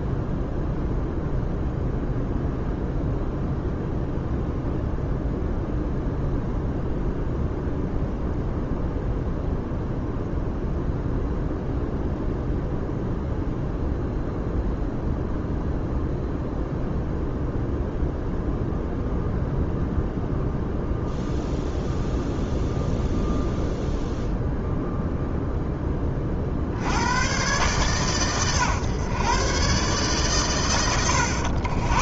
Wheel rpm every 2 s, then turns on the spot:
0, 0, 0, 0, 0, 0, 0, 0, 0, 0, 0, 0, 0, 70, 130, 120.
none